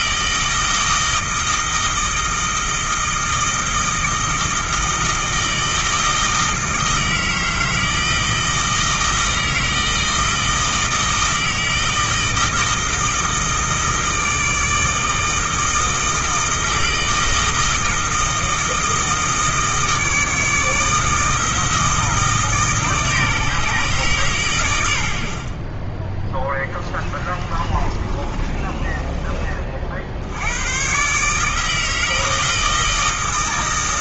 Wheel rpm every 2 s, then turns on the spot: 160, 160, 160, 160, 160, 160, 160, 160, 160, 160, 160, 150, 100, 20, 30, 110, 160.
26-30